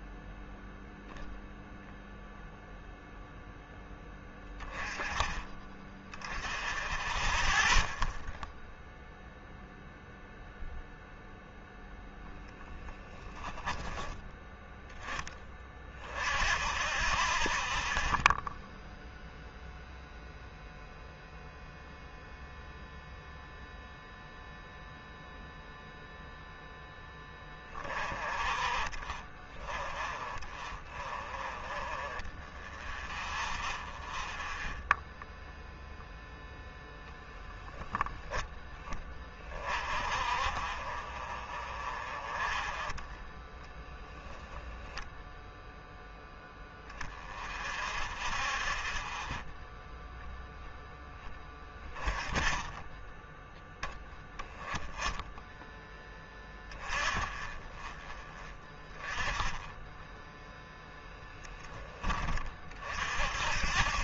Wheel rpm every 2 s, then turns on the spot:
0, 0, 10, 10, 0, 0, 10, 10, 10, 0, 0, 0, 0, 0, 30, 20, 10, 0, 0, 10, 40, 20, 0, 0, 0, 10, 0, 0, 0, 10, 0, 30.
none